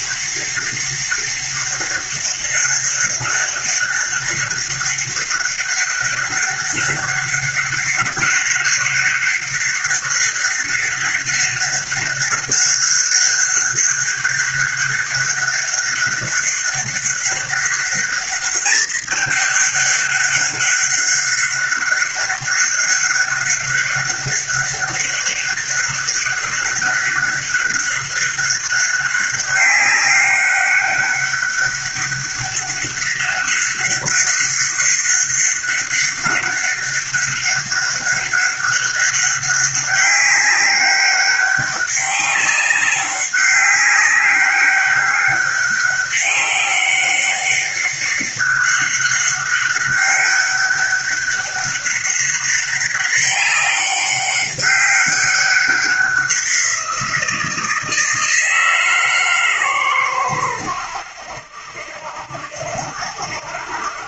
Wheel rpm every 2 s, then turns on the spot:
200, 200, 200, 200, 200, 200, 200, 200, 200, 200, 200, 200, 200, 200, 200, 200, 200, 200, 200, 200, 200, 190, 190, 200, 200, 200, 200, 190, 190, 160, 100, 70.
none